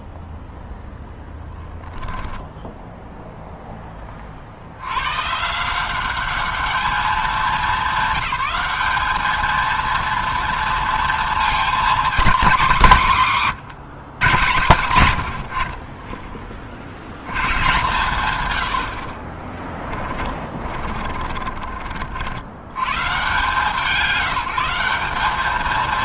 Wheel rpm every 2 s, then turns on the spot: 10, 10, 50, 200, 200, 230, 230, 160, 30, 130, 30, 70, 170.
0-4 20-22